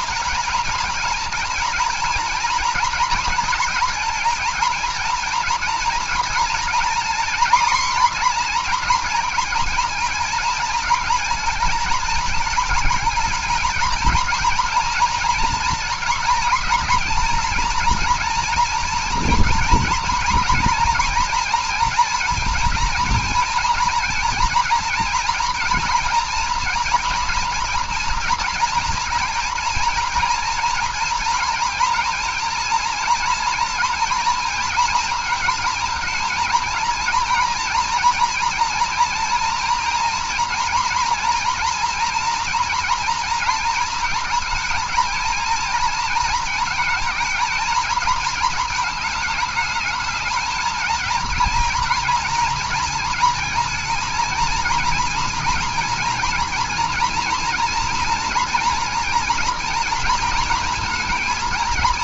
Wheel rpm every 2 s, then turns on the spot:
230, 240, 230, 240, 240, 220, 220, 230, 230, 230, 230, 230, 230, 230, 230, 230, 230, 230, 230, 230, 240, 230, 220, 230, 220, 220, 230, 230, 230, 240, 230.
none